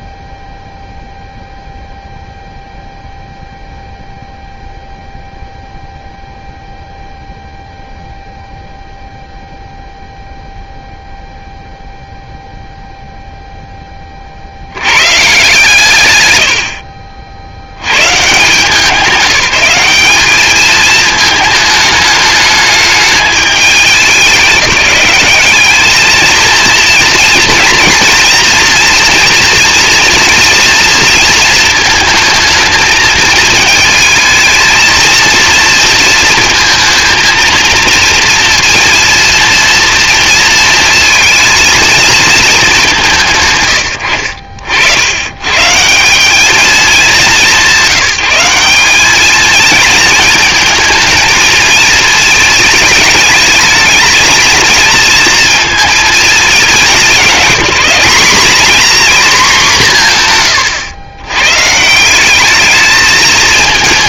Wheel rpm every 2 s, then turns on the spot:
0, 0, 0, 0, 0, 0, 0, 130, 70, 190, 220, 210, 200, 230, 230, 230, 220, 230, 220, 230, 220, 190, 80, 210, 210, 220, 210, 220, 200, 250, 100, 210.
none